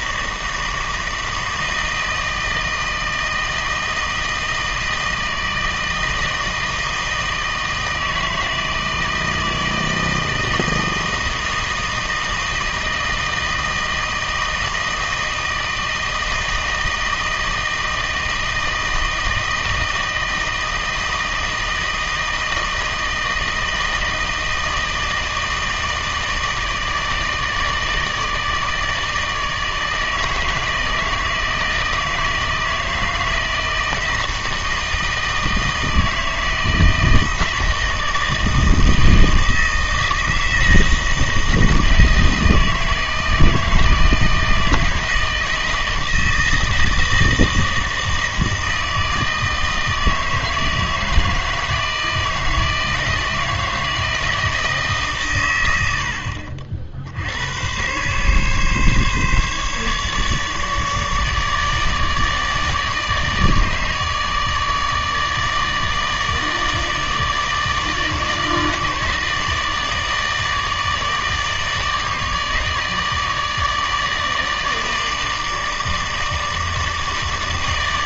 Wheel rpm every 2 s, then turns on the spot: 160, 160, 160, 160, 160, 160, 160, 160, 160, 160, 160, 160, 160, 160, 160, 160, 160, 160, 160, 160, 160, 160, 160, 160, 160, 160, 160, 160, 60, 140, 150, 150, 160, 150, 160, 150, 150, 160, 160.
none